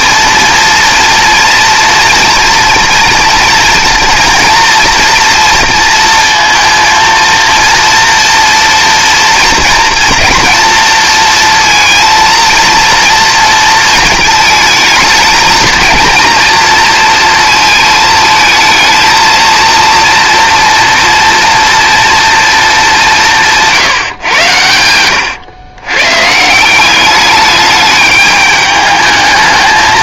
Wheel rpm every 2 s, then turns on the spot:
230, 230, 240, 230, 230, 220, 230, 220, 230, 220, 230, 220, 100, 180, 210.
none